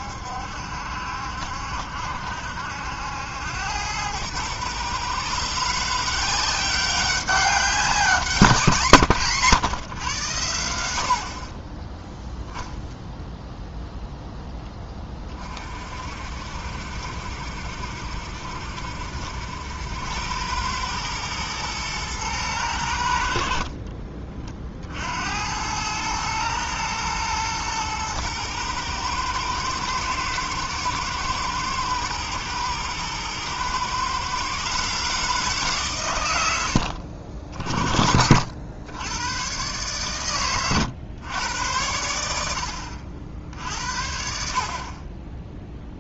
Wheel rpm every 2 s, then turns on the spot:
70, 80, 130, 190, 160, 80, 0, 10, 60, 70, 110, 90, 60, 110, 110, 110, 110, 140, 70, 90, 110, 60, 50.
none